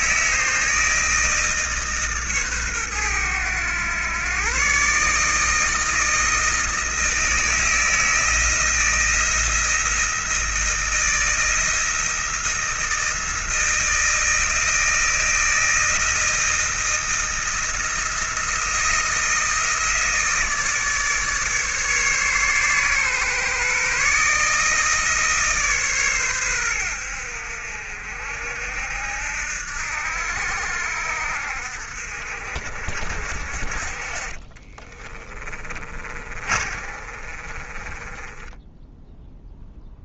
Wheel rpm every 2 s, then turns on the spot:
160, 110, 140, 160, 160, 160, 160, 160, 170, 170, 150, 130, 150, 90, 70, 70, 50, 20, 40, 10.
34-40